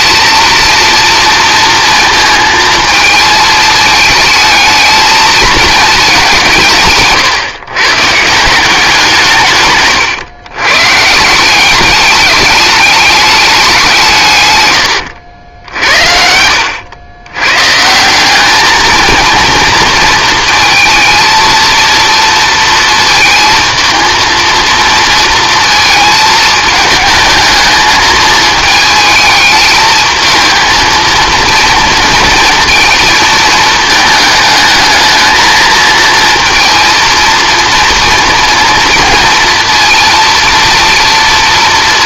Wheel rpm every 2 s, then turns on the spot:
230, 220, 220, 160, 170, 130, 210, 130, 80, 220, 230, 230, 230, 220, 220, 230, 230, 220, 230, 230, 230.
none